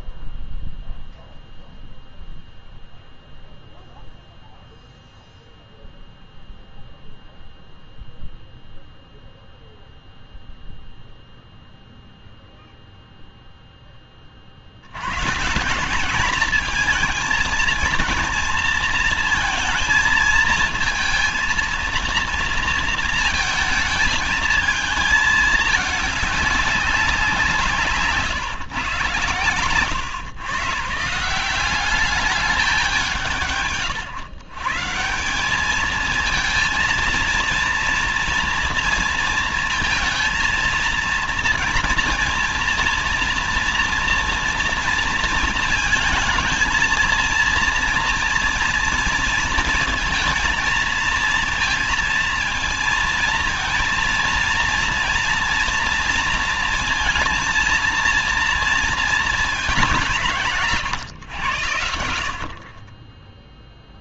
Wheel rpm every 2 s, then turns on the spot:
0, 0, 0, 0, 0, 0, 0, 60, 220, 230, 220, 230, 220, 200, 140, 140, 180, 140, 230, 230, 230, 230, 230, 230, 230, 230, 230, 230, 230, 230, 160, 40.
none